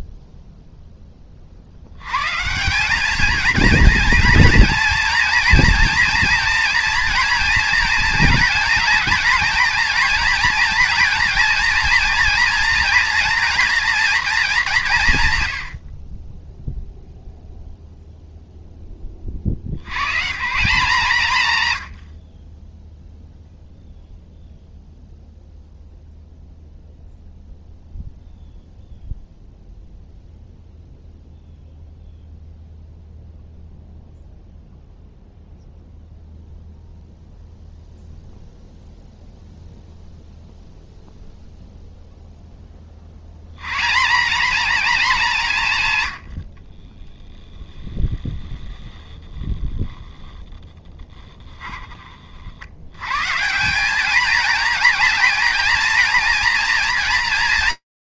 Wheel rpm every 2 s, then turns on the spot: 0, 160, 230, 230, 230, 230, 230, 200, 0, 0, 150, 20, 0, 0, 0, 0, 0, 0, 0, 0, 0, 10, 220, 60, 10, 10, 70, 220, 230.
48-50